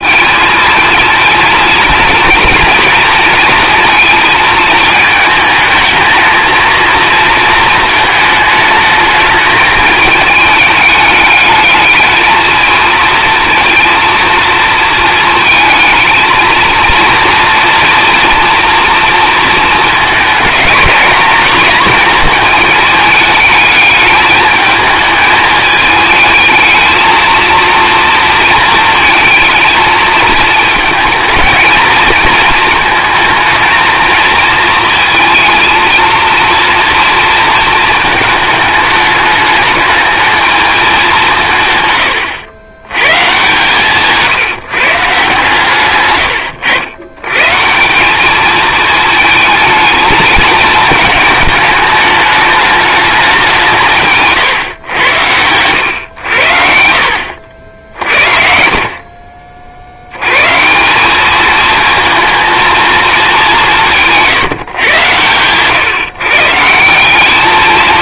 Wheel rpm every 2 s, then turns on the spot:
220, 240, 220, 230, 210, 210, 220, 230, 230, 230, 210, 220, 220, 220, 220, 220, 230, 230, 230, 220, 210, 100, 140, 100, 220, 220, 210, 110, 70, 50, 160, 230, 130, 170.
none